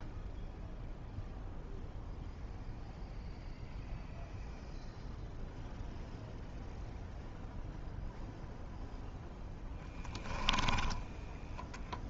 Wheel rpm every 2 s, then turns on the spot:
0, 0, 0, 0, 10, 20.
10-12